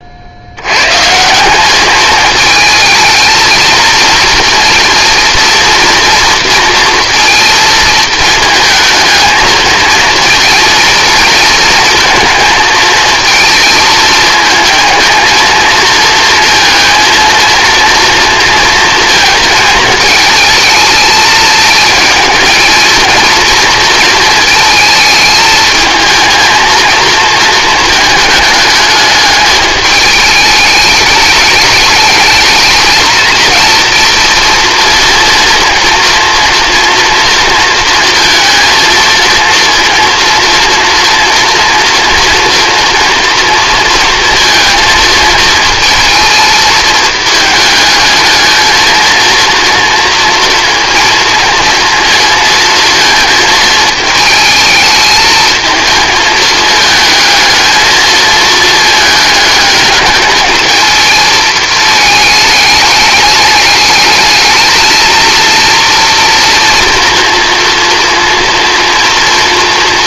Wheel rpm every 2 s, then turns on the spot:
100, 220, 240, 230, 220, 230, 230, 220, 230, 230, 220, 230, 220, 230, 220, 210, 220, 230, 240, 230, 240, 230, 230, 220, 230, 230, 230, 220, 220, 220, 220, 210, 220, 230, 240.
none